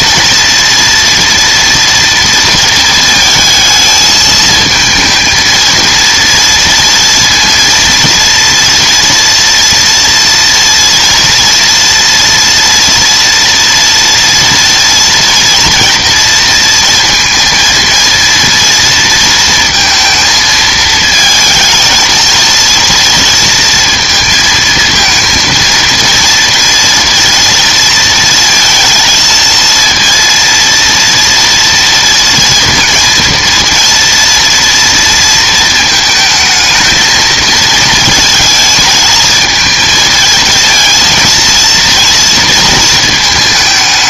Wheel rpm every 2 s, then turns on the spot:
230, 230, 220, 230, 230, 240, 230, 230, 230, 230, 220, 230, 230, 230, 220, 230, 230, 230, 220, 220, 220, 230.
none